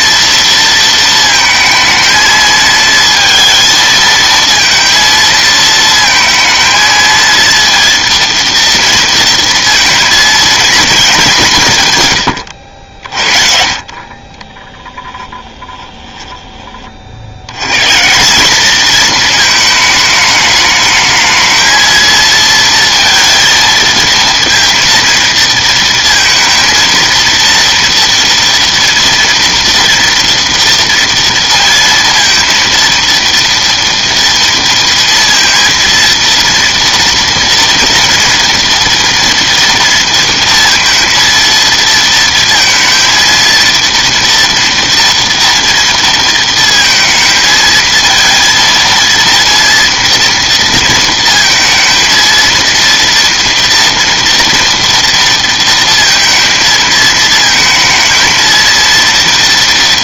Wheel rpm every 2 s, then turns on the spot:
230, 220, 230, 230, 230, 220, 70, 20, 20, 200, 220, 230, 230, 230, 230, 230, 230, 230, 230, 230, 230, 230, 230, 230, 230, 230, 230, 230, 220, 230.
14-16